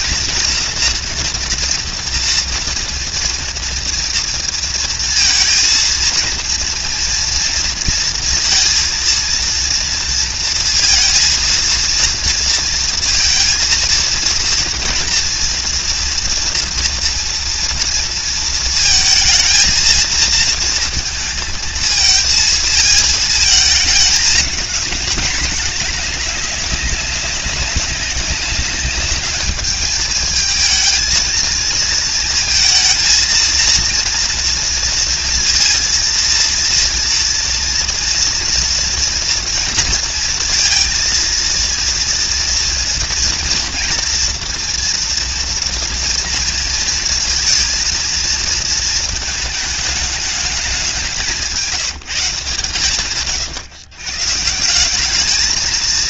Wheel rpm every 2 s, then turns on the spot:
230, 240, 230, 230, 230, 230, 230, 230, 230, 230, 230, 220, 210, 210, 200, 210, 230, 230, 230, 230, 230, 230, 240, 230, 220, 210, 170, 130.
none